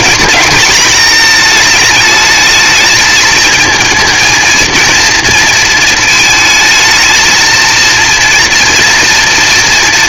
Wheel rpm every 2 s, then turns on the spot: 230, 220, 230, 220, 230.
none